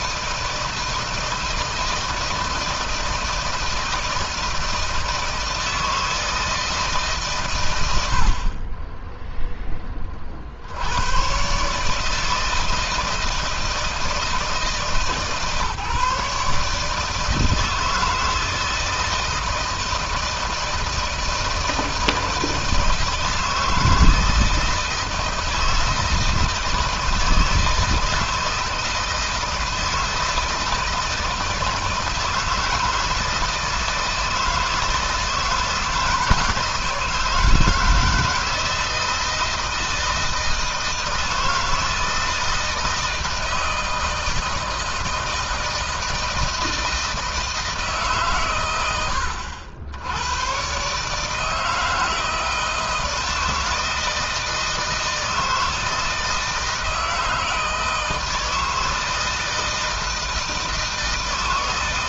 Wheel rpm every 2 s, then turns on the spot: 160, 160, 170, 150, 20, 80, 160, 160, 150, 160, 160, 160, 160, 160, 160, 160, 160, 160, 160, 160, 160, 160, 160, 160, 90, 130, 160, 160, 160, 160, 160.
none